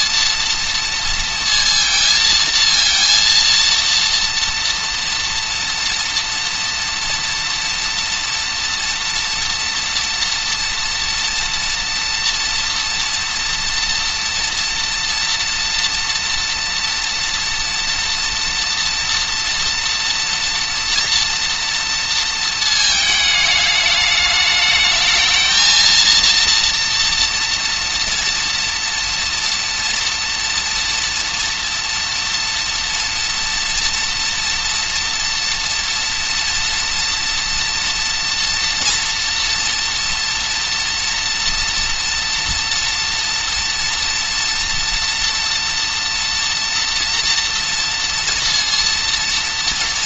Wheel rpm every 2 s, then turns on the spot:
230, 230, 230, 240, 240, 230, 230, 230, 230, 240, 230, 220, 210, 230, 230, 230, 230, 230, 240, 230, 230, 230, 240, 230, 230.
none